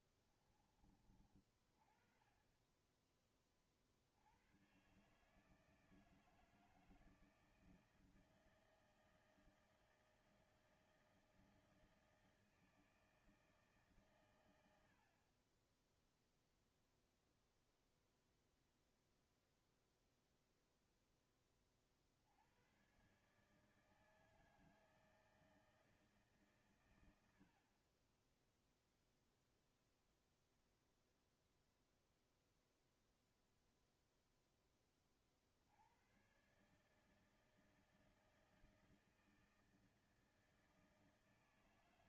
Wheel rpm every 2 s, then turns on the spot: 40, 30, 80, 160, 160, 160, 160, 120, 0, 0, 0, 70, 160, 150, 30, 0, 0, 0, 120, 160, 160.
0-2